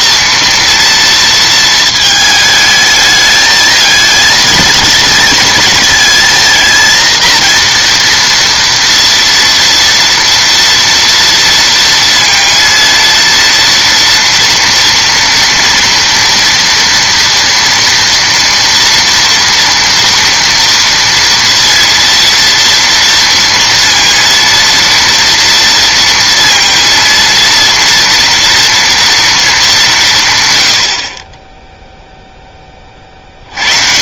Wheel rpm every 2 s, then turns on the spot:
230, 220, 230, 230, 230, 230, 230, 230, 230, 230, 230, 230, 230, 230, 230, 80, 20.
none